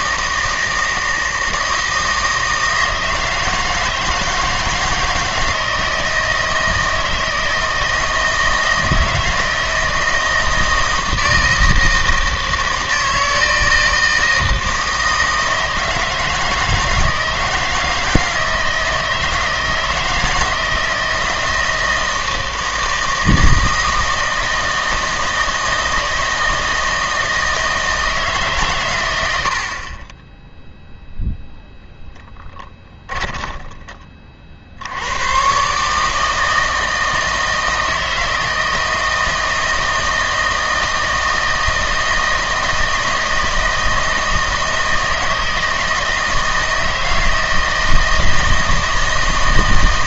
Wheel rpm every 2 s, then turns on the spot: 160, 160, 160, 160, 160, 160, 160, 160, 160, 160, 160, 160, 160, 160, 140, 0, 10, 60, 160, 160, 160, 160, 160, 160, 160.
32-34